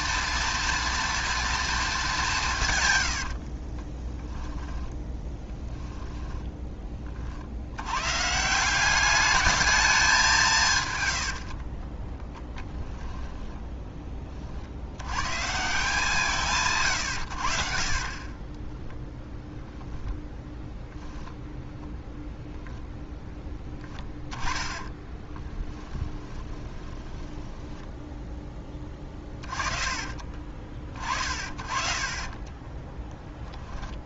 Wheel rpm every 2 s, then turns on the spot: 230, 110, 10, 20, 190, 120, 10, 100, 130, 10, 10, 20, 20, 10, 20, 30, 10.
2-4 10-14 24-34